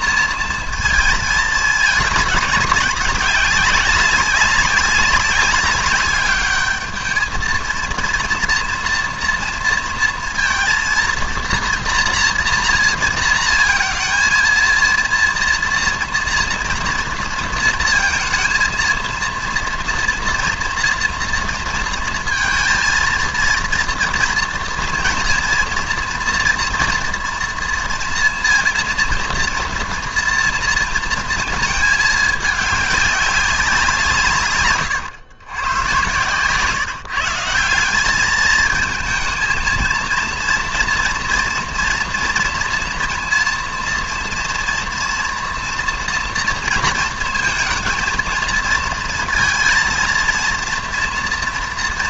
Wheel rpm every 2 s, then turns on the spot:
230, 200, 190, 210, 230, 230, 230, 230, 230, 230, 240, 230, 230, 240, 230, 230, 200, 130, 150, 220, 230, 230, 230, 230, 230, 230.
34-36